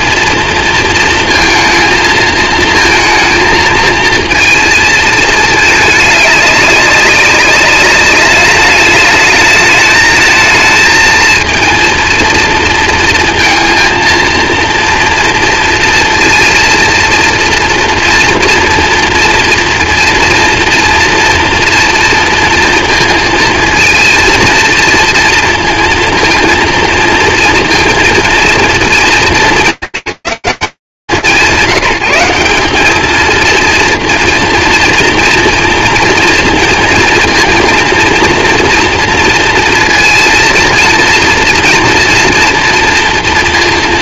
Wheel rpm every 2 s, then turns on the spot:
230, 230, 230, 200, 210, 220, 230, 230, 230, 230, 230, 230, 230, 230, 230, 170, 180, 230, 230, 230, 230, 230.
none